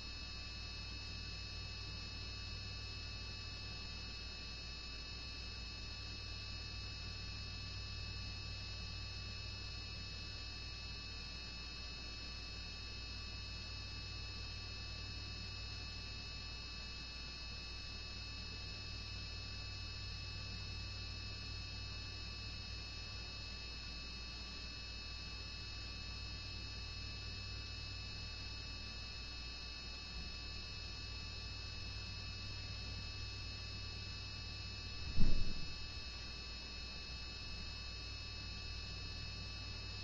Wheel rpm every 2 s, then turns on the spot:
0, 0, 0, 0, 0, 0, 0, 0, 0, 0, 0, 0, 0, 0, 0, 0, 0, 0, 0, 0.
none